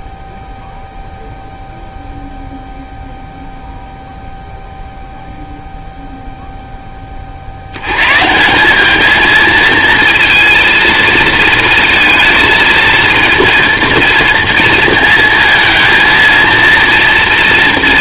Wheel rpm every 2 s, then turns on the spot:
0, 0, 0, 60, 220, 230, 230, 230, 230.
none